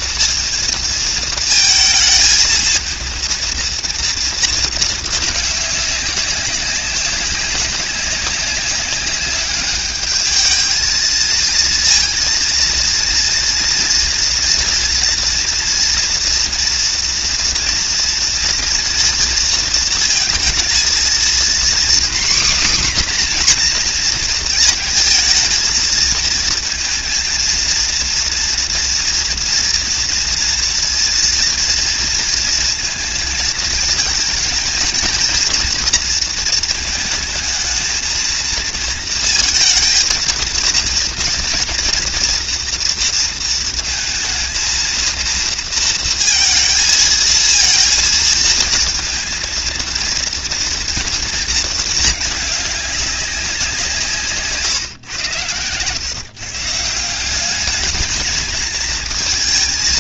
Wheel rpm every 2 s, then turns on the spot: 230, 230, 220, 200, 190, 220, 230, 230, 240, 230, 230, 260, 230, 230, 230, 230, 220, 230, 220, 230, 230, 230, 230, 230, 230, 230, 200, 120, 170, 230.
none